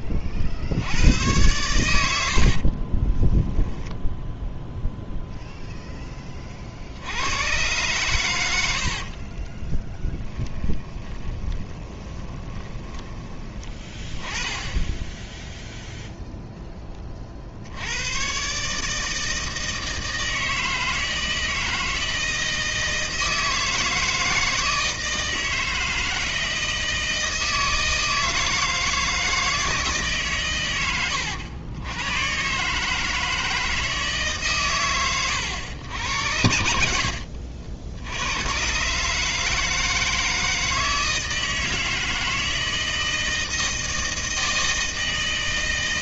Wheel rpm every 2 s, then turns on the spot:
80, 30, 0, 60, 70, 10, 20, 10, 20, 150, 160, 160, 160, 160, 160, 100, 150, 110, 70, 130, 160, 160, 160.
2-4 8-14